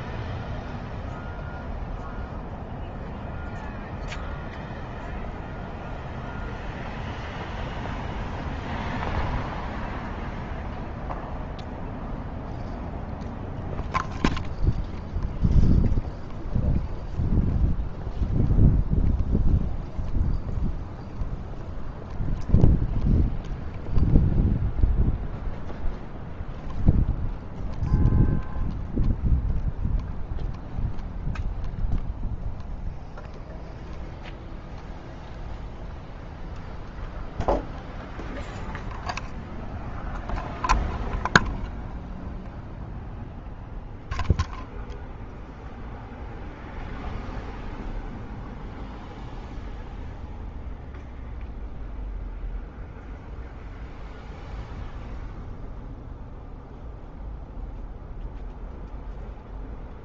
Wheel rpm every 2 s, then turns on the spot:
0, 0, 0, 0, 0, 0, 0, 0, 0, 0, 0, 0, 0, 0, 0, 0, 0, 0, 0, 0, 0, 0, 0, 0, 0, 0, 0, 0, 0, 0.
none